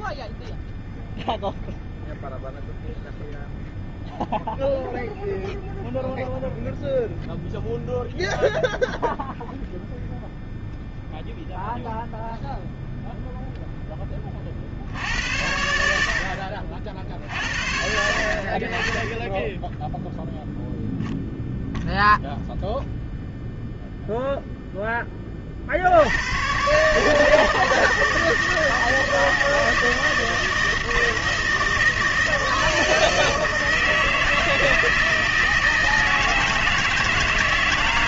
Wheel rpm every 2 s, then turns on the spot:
0, 0, 0, 0, 0, 0, 0, 50, 60, 40, 0, 0, 0, 120, 160, 160, 160, 160, 160.
none